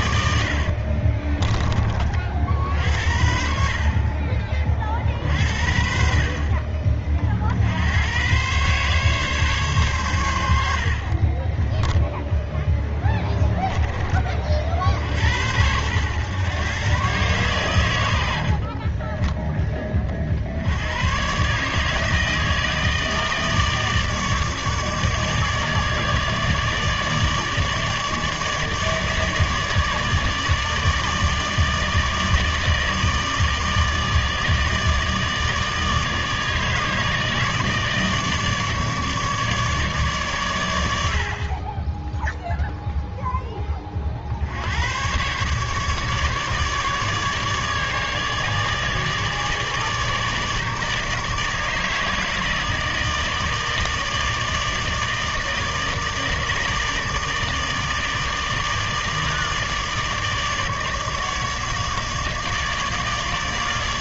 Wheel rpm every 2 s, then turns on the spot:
70, 50, 30, 40, 130, 70, 0, 40, 130, 60, 70, 160, 150, 150, 150, 150, 150, 150, 150, 150, 110, 0, 80, 150, 150, 150, 160, 160, 150, 160, 150, 150.
0-2 18-20